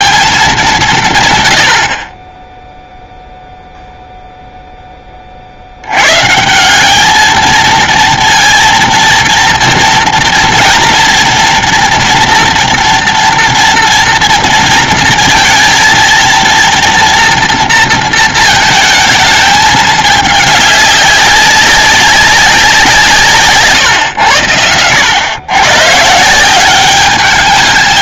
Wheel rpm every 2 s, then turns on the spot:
160, 0, 20, 210, 230, 230, 230, 230, 230, 220, 200, 170, 100, 200.
none